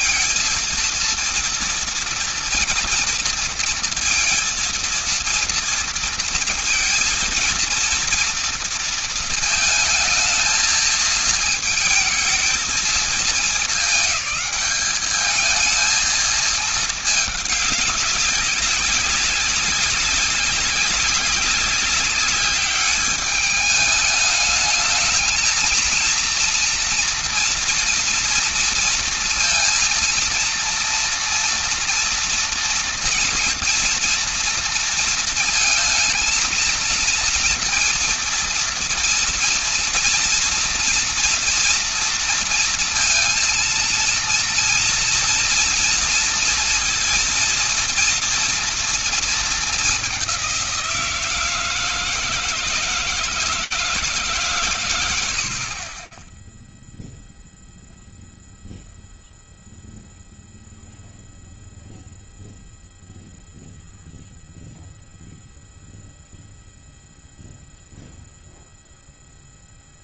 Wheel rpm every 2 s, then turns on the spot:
230, 230, 230, 230, 230, 220, 220, 210, 220, 190, 190, 200, 220, 240, 230, 230, 230, 230, 230, 230, 230, 230, 230, 230, 230, 170, 160, 130, 0, 0, 0, 0, 0, 0, 0.
none